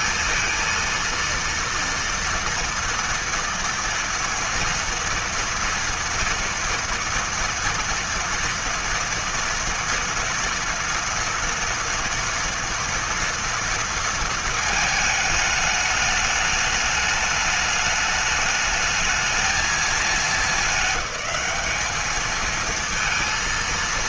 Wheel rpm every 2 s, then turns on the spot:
230, 230, 230, 230, 230, 230, 230, 220, 210, 210, 210, 220.
none